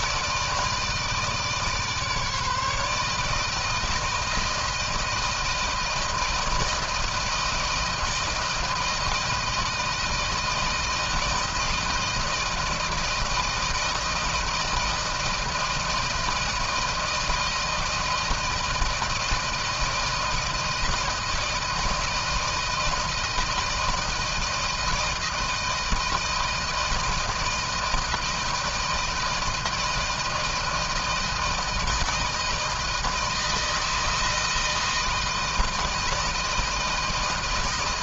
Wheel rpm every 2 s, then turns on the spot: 160, 150, 160, 160, 160, 160, 160, 160, 160, 160, 160, 160, 160, 160, 160, 160, 160, 160, 160.
none